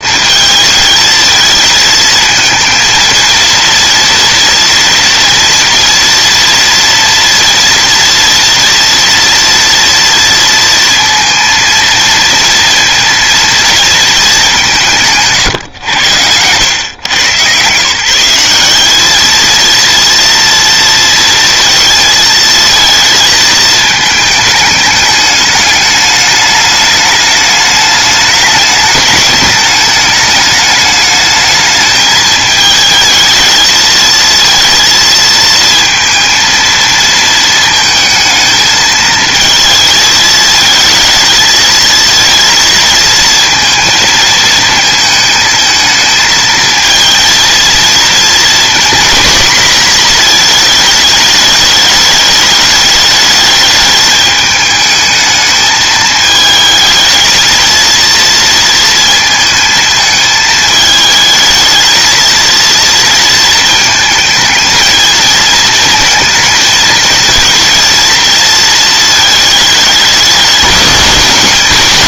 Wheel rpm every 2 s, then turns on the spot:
220, 230, 230, 230, 230, 230, 230, 180, 100, 190, 230, 220, 210, 210, 210, 210, 220, 230, 230, 220, 220, 230, 220, 230, 230, 220, 210, 210, 220, 230, 220, 230, 220, 220, 230, 200.
none